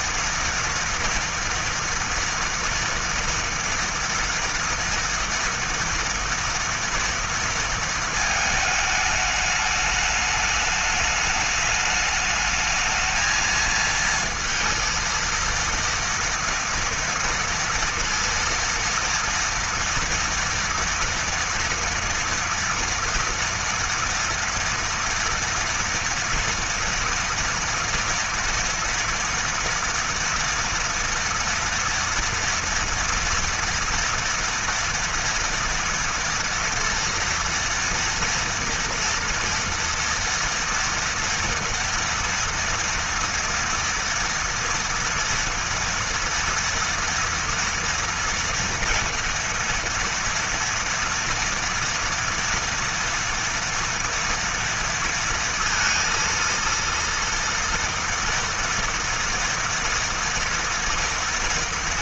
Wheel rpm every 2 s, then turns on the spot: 240, 230, 230, 230, 210, 210, 220, 230, 230, 230, 230, 230, 230, 240, 230, 230, 230, 230, 230, 230, 230, 230, 230, 240, 230, 230, 230, 230, 230, 230, 230.
none